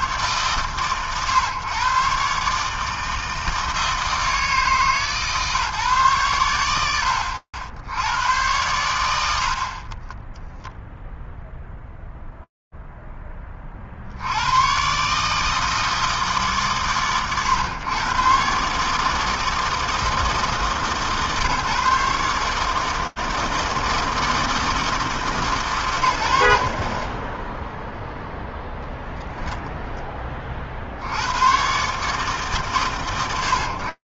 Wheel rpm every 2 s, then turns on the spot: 110, 120, 160, 140, 70, 40, 0, 50, 160, 120, 160, 140, 160, 120, 0, 10, 110.
none